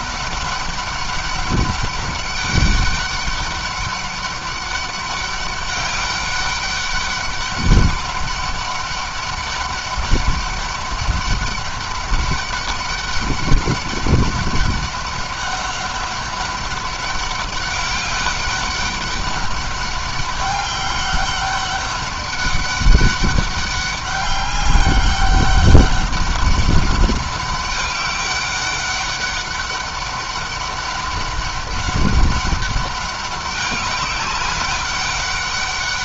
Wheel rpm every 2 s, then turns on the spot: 200, 200, 200, 200, 200, 200, 200, 200, 200, 200, 200, 200, 200, 200, 200, 200, 200, 200.
none